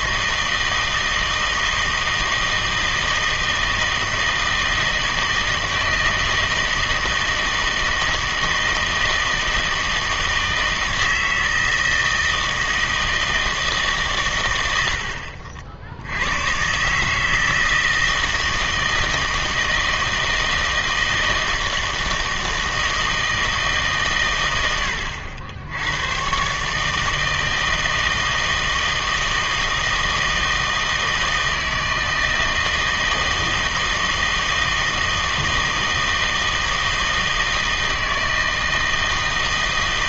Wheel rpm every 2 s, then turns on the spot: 160, 160, 160, 160, 160, 160, 160, 100, 110, 160, 160, 160, 100, 130, 160, 160, 160, 160, 160, 160.
none